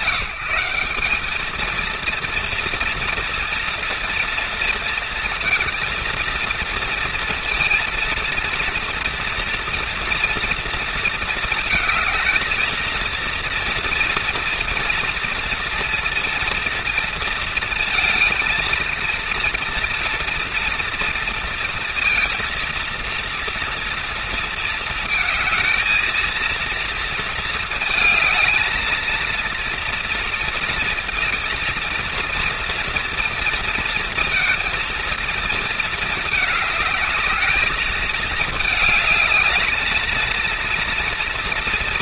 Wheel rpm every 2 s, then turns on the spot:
190, 230, 230, 230, 230, 230, 220, 230, 230, 230, 230, 230, 230, 230, 220, 230, 230, 230, 210, 220, 230.
none